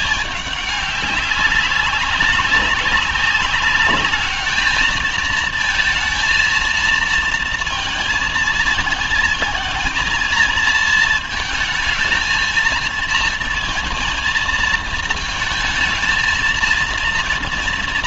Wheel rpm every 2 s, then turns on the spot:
200, 200, 210, 230, 230, 230, 220, 230, 230.
none